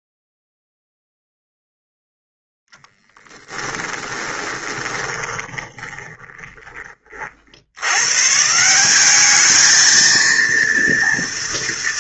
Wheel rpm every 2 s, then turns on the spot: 0, 10, 20, 20, 150, 230.
4-8